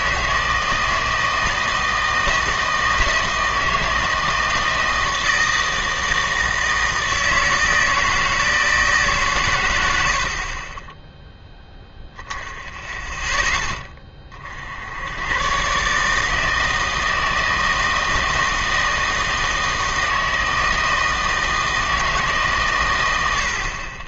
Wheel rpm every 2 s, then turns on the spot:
160, 160, 160, 160, 160, 20, 10, 70, 160, 160, 160, 140.
none